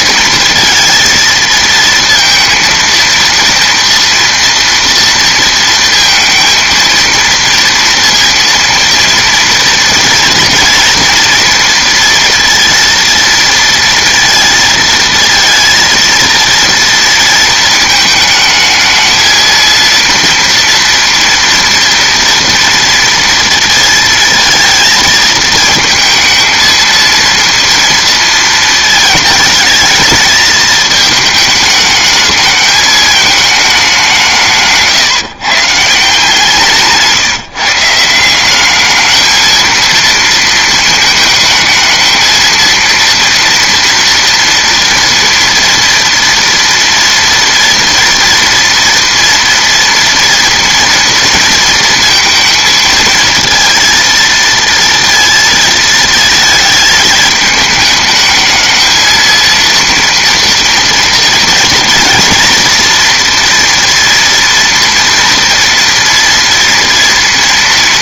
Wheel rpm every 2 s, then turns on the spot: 230, 230, 230, 230, 230, 230, 230, 230, 230, 220, 230, 230, 220, 220, 220, 210, 210, 180, 170, 200, 230, 230, 240, 230, 230, 230, 230, 230, 220, 220, 240, 230, 230, 230.
36-38